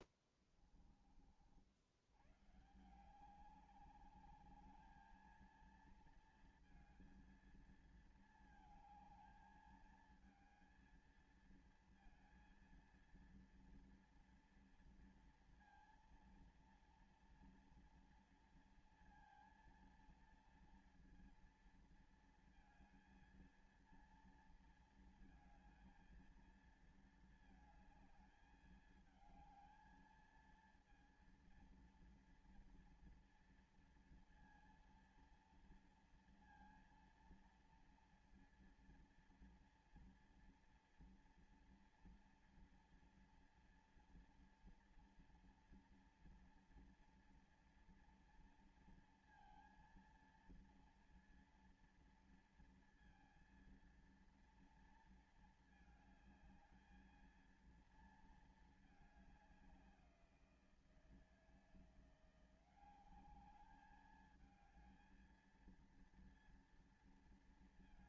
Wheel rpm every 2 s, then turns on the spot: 10, 110, 200, 230, 220, 220, 230, 240, 230, 230, 230, 230, 230, 230, 220, 220, 230, 230, 230, 230, 230, 230, 230, 240, 230, 230, 230, 230, 220, 220, 180, 170, 210, 230.
0-2